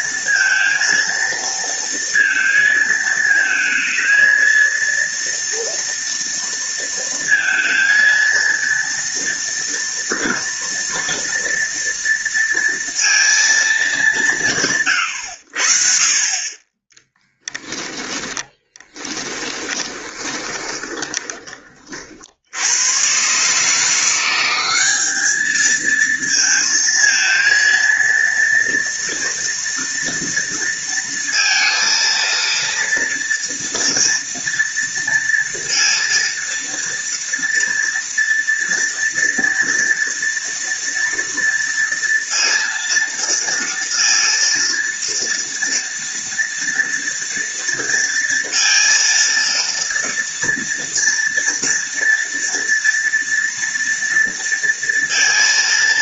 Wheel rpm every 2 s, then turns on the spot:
230, 220, 230, 230, 230, 230, 230, 130, 20, 10, 20, 110, 200, 230, 230, 230, 230, 230, 230, 230, 230, 230, 230, 230, 230, 230, 230, 230.
18-22